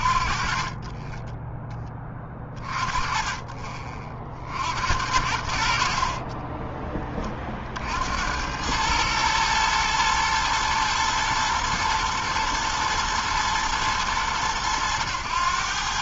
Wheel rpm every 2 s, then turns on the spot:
30, 20, 50, 30, 90, 110, 110, 110.
6-8